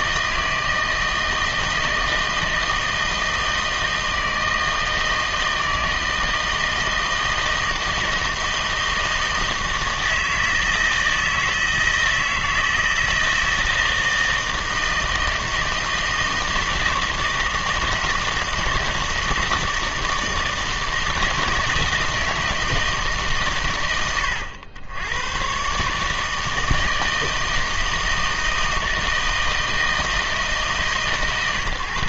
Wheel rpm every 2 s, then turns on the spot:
160, 160, 160, 160, 160, 160, 160, 160, 160, 160, 160, 160, 100, 160, 160, 150.
none